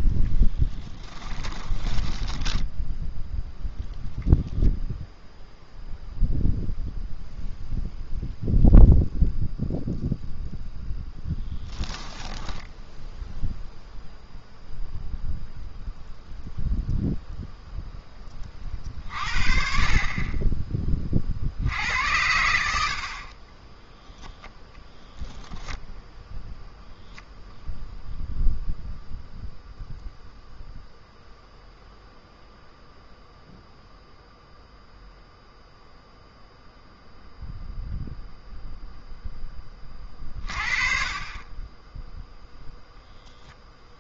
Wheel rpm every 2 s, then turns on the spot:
10, 10, 0, 0, 0, 0, 10, 0, 0, 40, 30, 70, 10, 0, 0, 0, 0, 0, 0, 0, 40, 0.
0-4 22-24